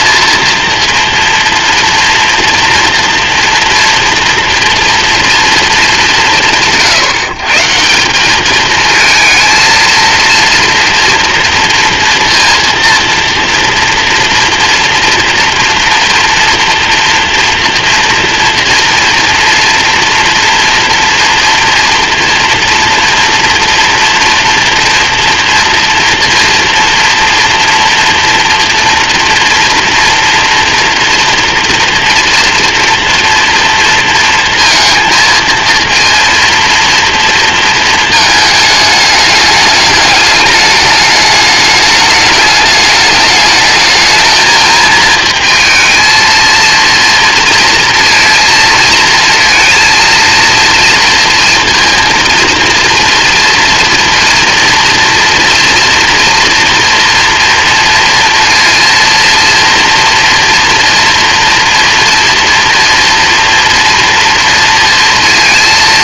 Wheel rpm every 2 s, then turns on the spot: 230, 230, 230, 150, 220, 230, 230, 230, 230, 230, 240, 230, 230, 230, 230, 230, 230, 230, 230, 210, 210, 210, 220, 230, 230, 230, 230, 230, 230, 230, 230, 230, 230.
none